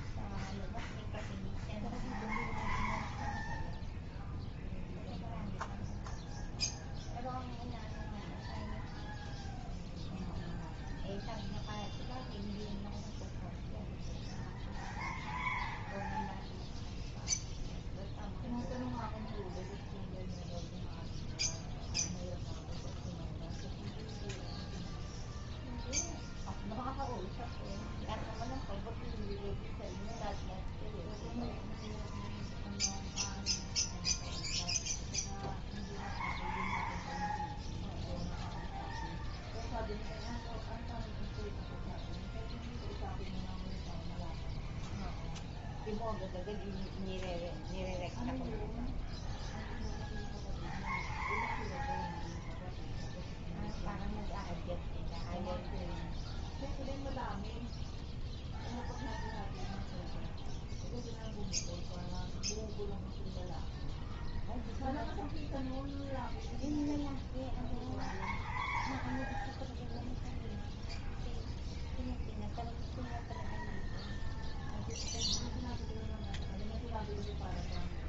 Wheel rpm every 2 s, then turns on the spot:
0, 0, 0, 0, 0, 0, 0, 0, 0, 0, 0, 0, 0, 0, 0, 0, 0, 0, 0, 0, 0, 0, 0, 0, 0, 0, 0, 0, 0, 0, 0, 0, 0, 0, 0, 0, 0, 0, 0.
none